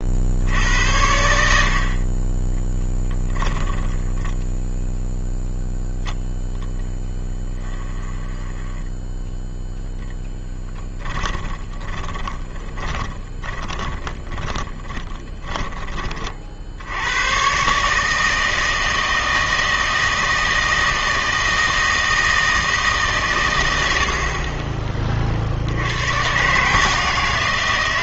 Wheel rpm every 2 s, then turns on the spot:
70, 10, 10, 10, 10, 10, 20, 10, 50, 160, 160, 160, 30, 140.
4-6 8-16